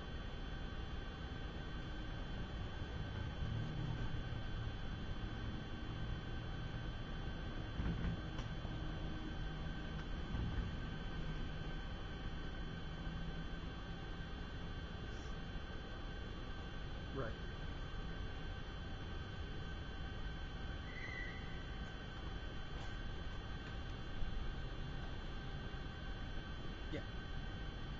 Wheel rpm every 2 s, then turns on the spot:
0, 0, 0, 0, 0, 0, 0, 0, 0, 0, 0, 0, 0, 0.
none